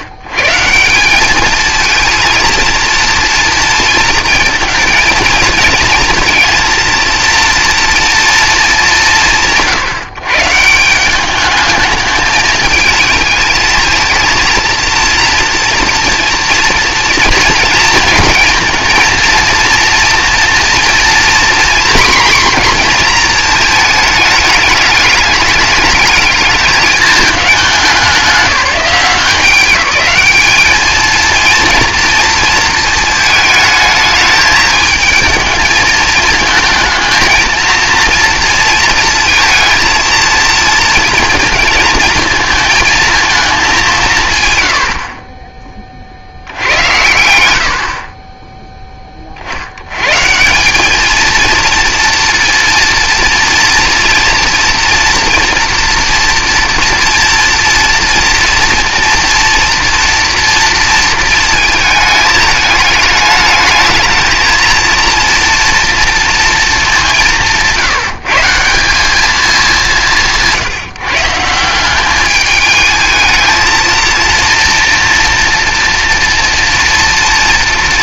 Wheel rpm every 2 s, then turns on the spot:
140, 230, 230, 230, 140, 170, 220, 230, 230, 230, 230, 240, 220, 210, 180, 210, 220, 220, 220, 230, 230, 230, 90, 70, 10, 190, 230, 240, 230, 230, 230, 220, 220, 230, 170, 180, 220, 230, 230.
none